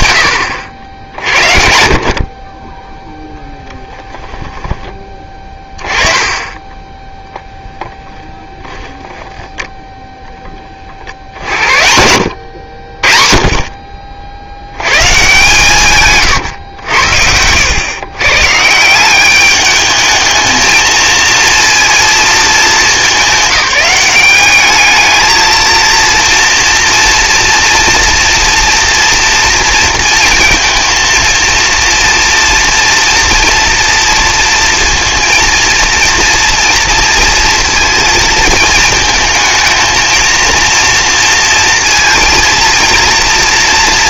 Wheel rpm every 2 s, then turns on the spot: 80, 30, 20, 10, 0, 20, 70, 100, 100, 150, 220, 220, 210, 230, 230, 230, 240, 230, 230, 220, 230, 230.
4-6 16-18